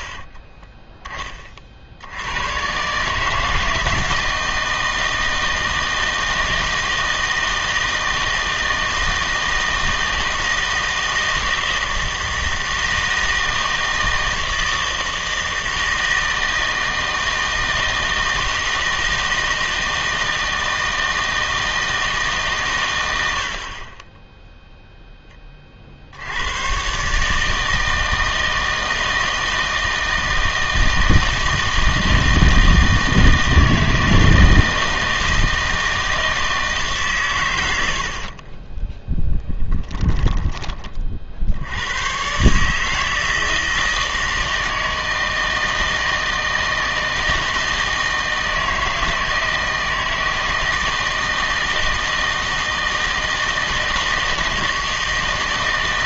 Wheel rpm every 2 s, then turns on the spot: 20, 120, 160, 160, 160, 160, 160, 160, 160, 160, 160, 130, 0, 110, 160, 160, 160, 160, 160, 20, 20, 140, 160, 160, 160, 160, 160, 160.
0-2 38-40